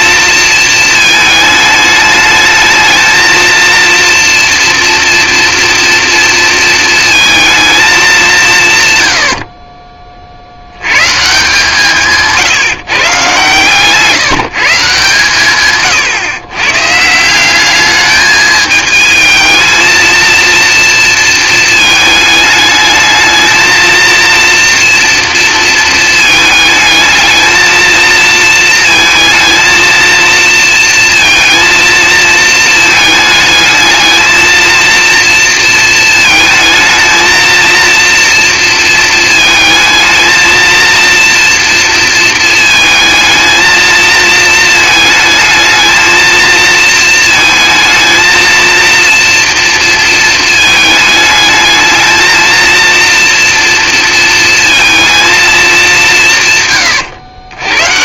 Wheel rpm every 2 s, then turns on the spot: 230, 220, 230, 230, 170, 70, 150, 150, 130, 210, 230, 220, 230, 220, 230, 230, 230, 220, 220, 230, 220, 220, 220, 220, 230, 230, 230, 230, 150.
none